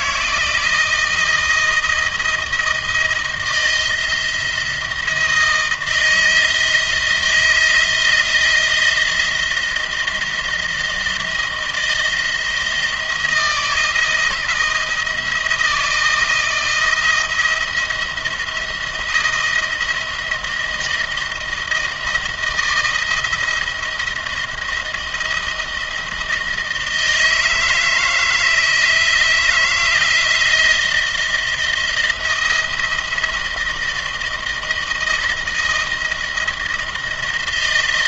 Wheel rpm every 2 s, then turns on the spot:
170, 160, 170, 160, 160, 160, 160, 170, 160, 170, 160, 160, 170, 160, 160, 170, 170, 160, 160.
none